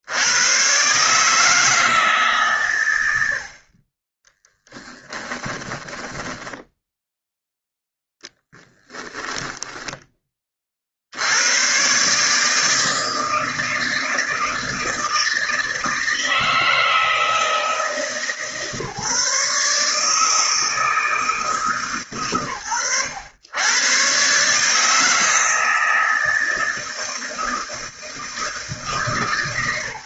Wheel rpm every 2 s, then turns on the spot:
130, 120, 10, 0, 20, 70, 160, 160, 160, 150, 160, 90, 150, 160, 160.
4-6 8-10